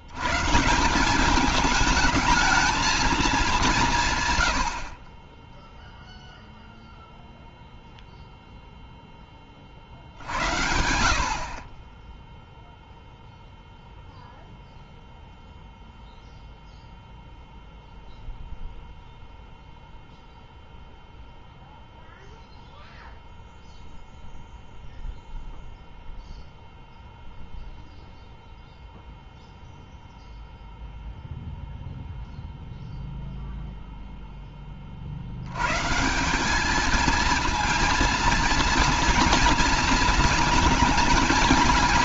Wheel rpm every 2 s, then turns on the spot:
160, 220, 70, 0, 0, 70, 0, 0, 0, 0, 0, 0, 0, 0, 0, 0, 0, 20, 210, 230, 220.
none